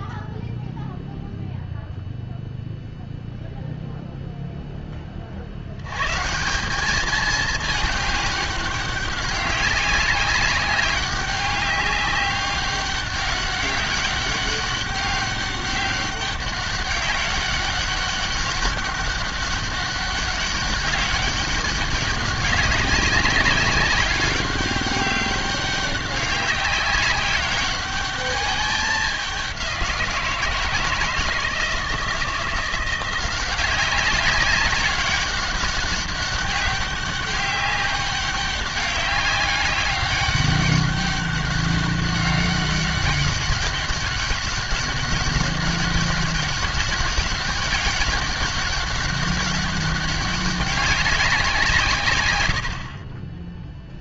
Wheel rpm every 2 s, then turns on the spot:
0, 0, 10, 180, 200, 200, 190, 200, 200, 200, 200, 200, 200, 190, 200, 160, 170, 190, 200, 200, 200, 200, 200, 200, 200, 200, 90.
52-54